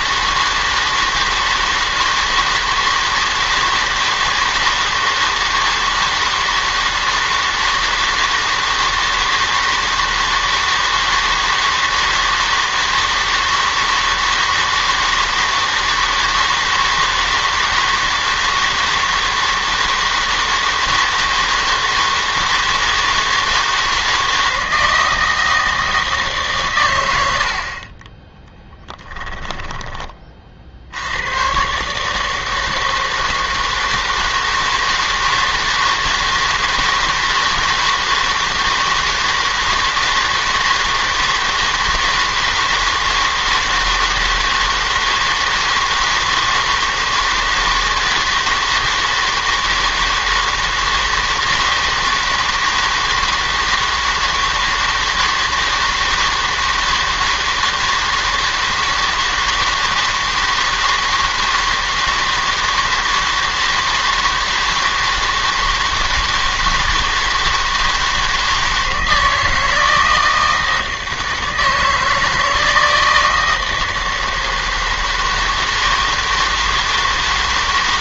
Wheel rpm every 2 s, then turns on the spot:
160, 160, 160, 160, 160, 160, 160, 160, 160, 160, 160, 160, 160, 140, 10, 40, 160, 160, 160, 160, 160, 160, 160, 160, 160, 160, 160, 160, 160, 160, 160, 160, 160, 160, 160, 160, 160, 160, 160.
28-30